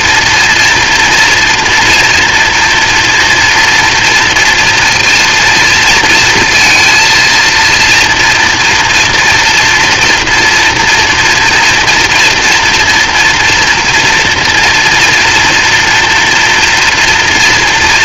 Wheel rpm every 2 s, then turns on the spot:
230, 230, 230, 230, 230, 230, 230, 230, 240.
none